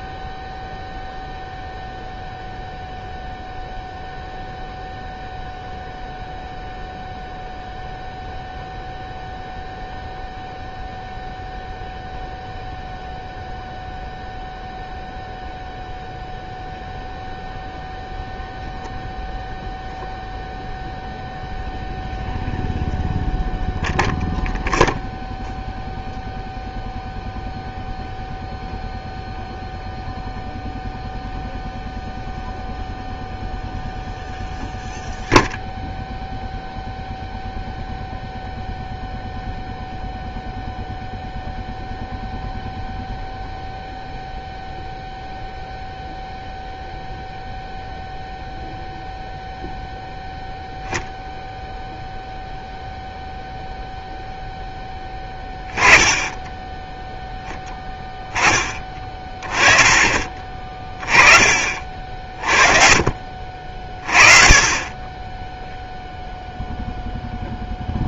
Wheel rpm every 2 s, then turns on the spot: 0, 0, 0, 0, 0, 0, 0, 0, 0, 0, 0, 0, 0, 0, 0, 0, 0, 0, 0, 0, 0, 0, 0, 0, 0, 0, 0, 10, 10, 20, 30, 40, 30, 0.
none